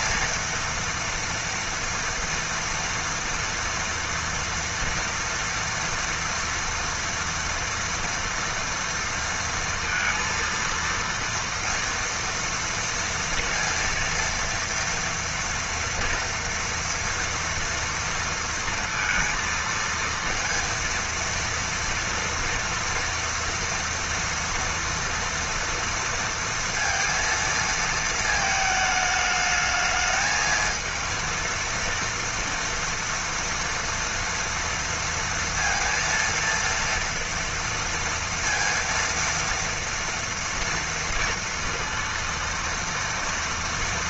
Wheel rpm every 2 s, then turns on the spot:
230, 230, 230, 240, 230, 230, 230, 230, 230, 230, 230, 240, 230, 230, 220, 220, 230, 230, 230, 230, 230, 230.
none